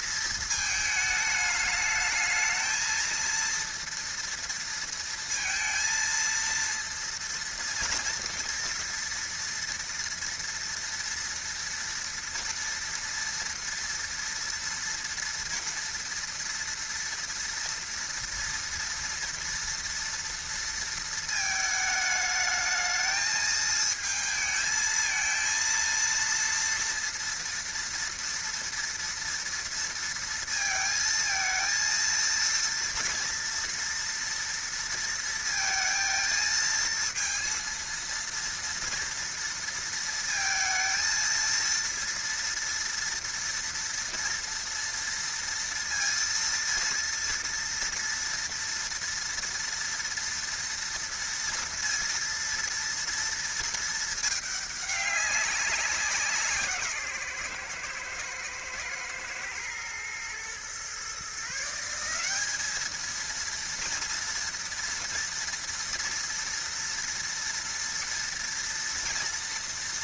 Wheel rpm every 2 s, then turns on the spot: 220, 220, 230, 230, 230, 230, 230, 230, 230, 230, 230, 210, 220, 230, 230, 230, 230, 230, 220, 230, 230, 230, 230, 230, 230, 230, 230, 210, 170, 110, 120, 210, 230, 230, 230.
none